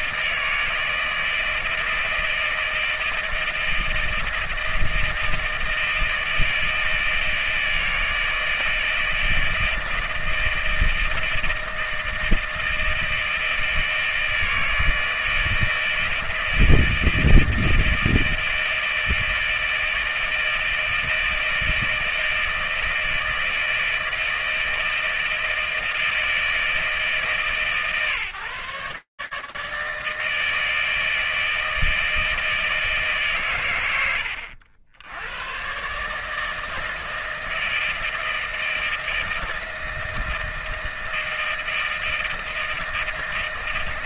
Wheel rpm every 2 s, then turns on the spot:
160, 160, 160, 160, 160, 160, 160, 160, 160, 160, 160, 160, 160, 160, 150, 160, 160, 70, 160, 160, 160, 160.
none